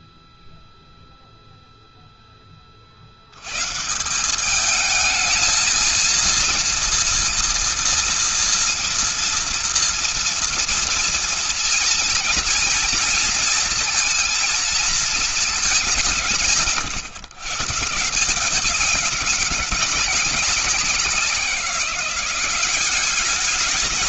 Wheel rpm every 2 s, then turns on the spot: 0, 50, 210, 230, 230, 230, 230, 220, 140, 190, 190, 190.
none